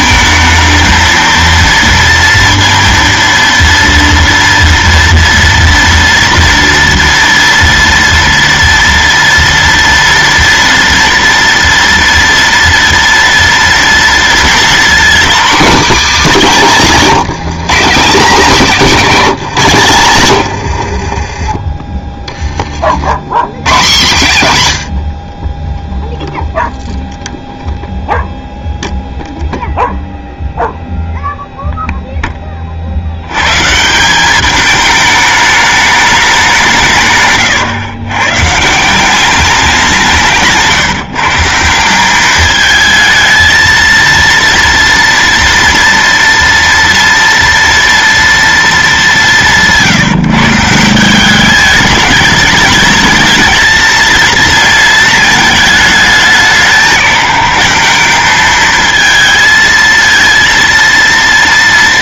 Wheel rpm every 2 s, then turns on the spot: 220, 230, 230, 230, 240, 240, 230, 230, 210, 220, 100, 40, 120, 0, 0, 0, 30, 210, 180, 160, 150, 210, 230, 240, 230, 160, 210, 230, 190, 220, 230.
20-22